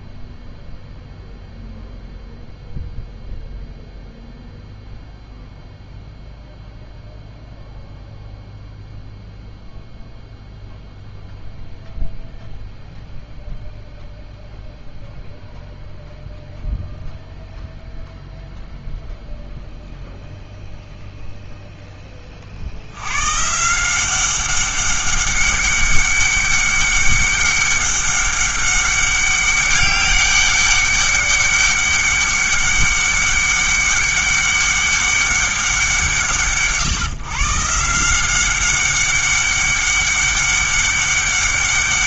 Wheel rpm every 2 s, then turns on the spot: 0, 0, 0, 0, 0, 0, 0, 0, 0, 0, 0, 70, 200, 200, 200, 200, 200, 200, 150, 190, 200.
none